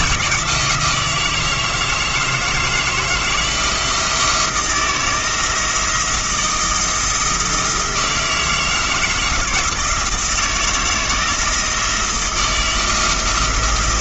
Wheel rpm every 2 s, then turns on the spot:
170, 160, 170, 160, 160, 160, 160.
none